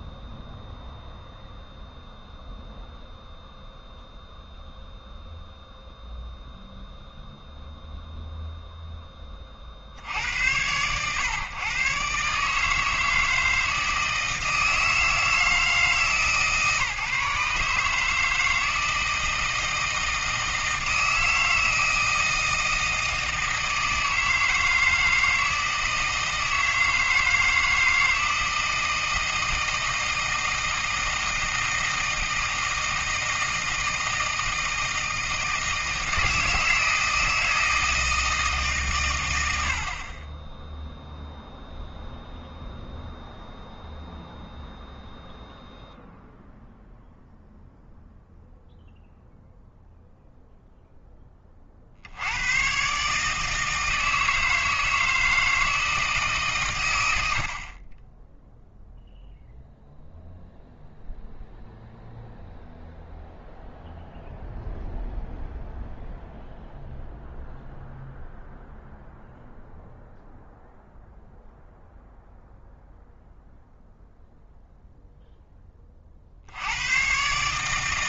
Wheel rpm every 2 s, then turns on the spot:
0, 0, 0, 0, 0, 100, 160, 160, 150, 160, 160, 160, 160, 160, 160, 160, 160, 160, 160, 130, 0, 0, 0, 0, 0, 0, 130, 160, 110, 0, 0, 0, 0, 0, 0, 0, 0, 0, 90.
none